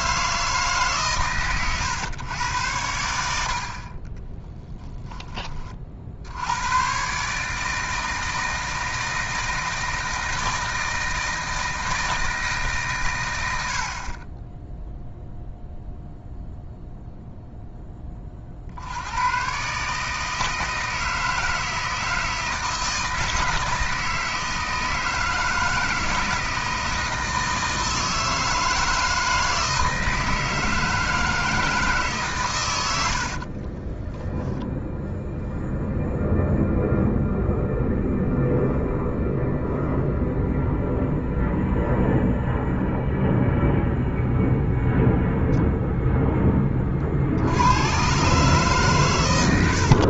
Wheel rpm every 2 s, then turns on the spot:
150, 90, 10, 110, 160, 160, 130, 0, 0, 80, 160, 160, 160, 160, 160, 160, 100, 0, 0, 0, 0, 0, 0, 30, 140.
none